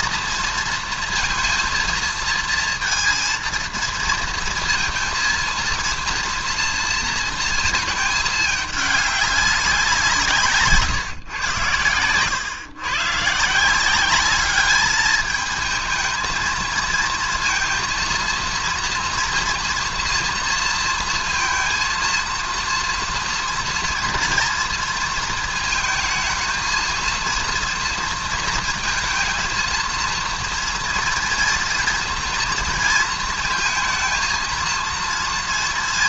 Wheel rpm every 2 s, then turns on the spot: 230, 230, 230, 230, 220, 170, 110, 200, 220, 230, 230, 230, 230, 220, 230, 230, 240, 220.
none